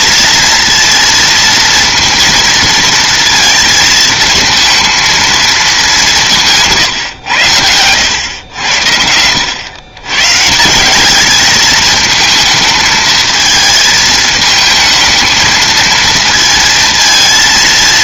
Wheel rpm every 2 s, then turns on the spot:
230, 230, 220, 150, 90, 180, 220, 220, 220.
none